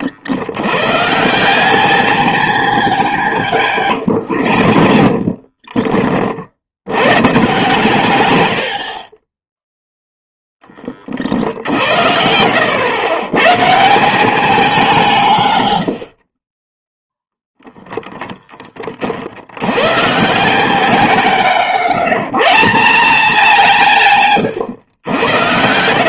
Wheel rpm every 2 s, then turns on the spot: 90, 80, 50, 70, 80, 10, 100, 190, 30, 20, 100, 160, 120.
4-6 16-18